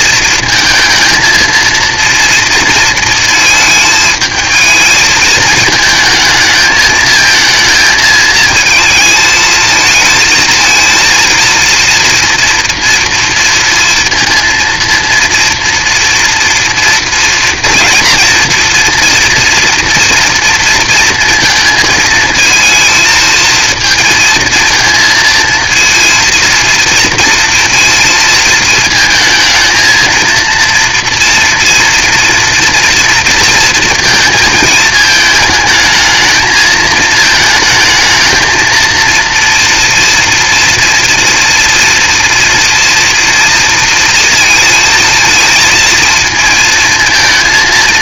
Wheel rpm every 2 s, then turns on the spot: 230, 230, 220, 220, 220, 230, 230, 230, 230, 230, 230, 220, 220, 230, 220, 230, 230, 220, 220, 230, 230, 230, 230, 220.
none